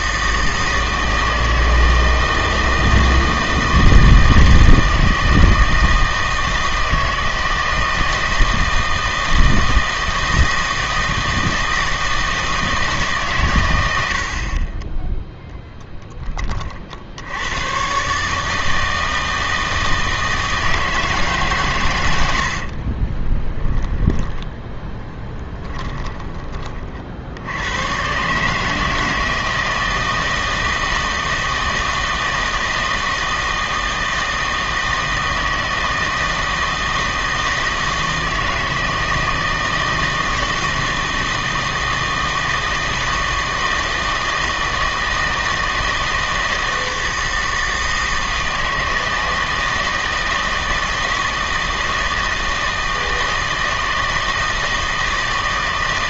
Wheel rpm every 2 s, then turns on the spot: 160, 160, 160, 160, 160, 160, 160, 40, 40, 160, 160, 60, 10, 30, 150, 160, 160, 160, 160, 160, 160, 160, 160, 160, 160, 160, 160, 160.
22-24